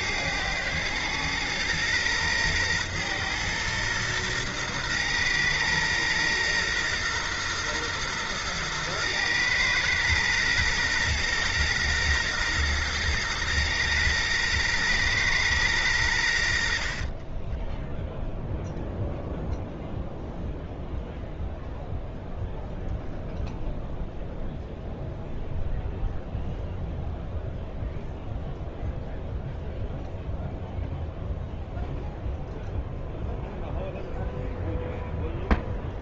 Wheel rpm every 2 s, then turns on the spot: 110, 120, 120, 120, 120, 120, 120, 120, 70, 0, 0, 0, 0, 0, 0, 0, 0, 0.
none